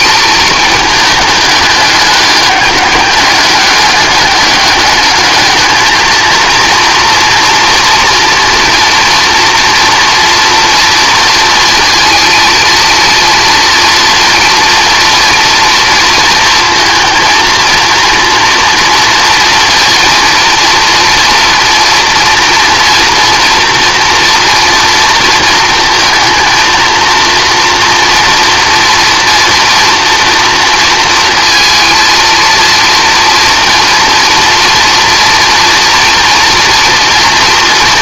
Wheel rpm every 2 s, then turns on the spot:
220, 200, 210, 230, 230, 230, 230, 230, 230, 230, 230, 230, 230, 230, 230, 230, 230, 240, 240.
none